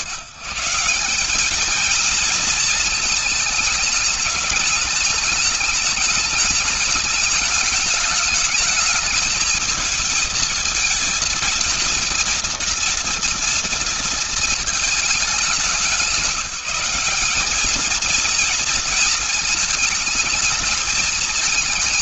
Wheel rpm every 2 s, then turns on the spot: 150, 230, 210, 210, 210, 220, 230, 230, 180, 230, 220.
none